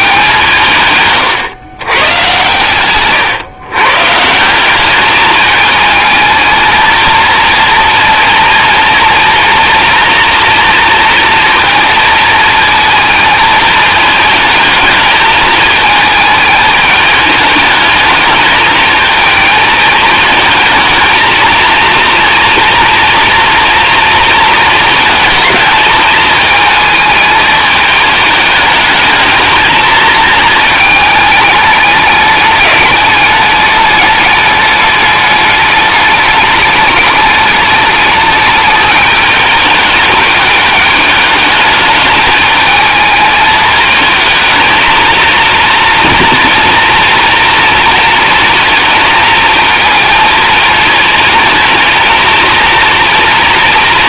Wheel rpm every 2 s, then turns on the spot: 140, 120, 200, 220, 230, 230, 220, 220, 210, 220, 220, 230, 220, 220, 210, 220, 210, 210, 210, 210, 210, 220, 230, 230, 220, 220, 230.
none